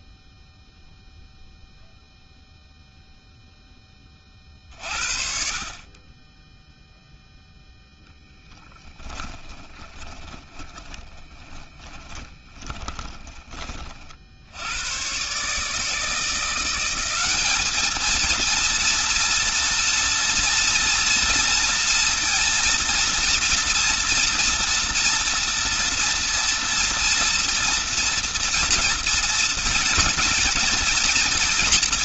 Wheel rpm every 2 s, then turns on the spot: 0, 0, 30, 20, 10, 20, 20, 70, 170, 230, 230, 230, 230, 230, 230, 230.
8-14